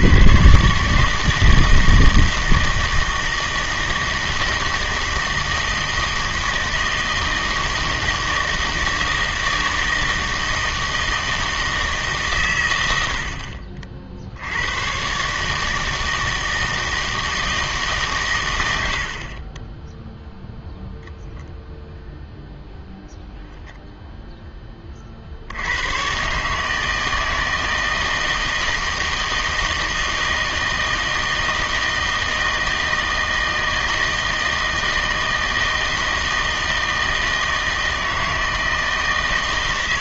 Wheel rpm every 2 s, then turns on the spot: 130, 160, 160, 160, 160, 160, 110, 90, 160, 100, 0, 0, 10, 150, 160, 160, 160, 160, 160, 160.
none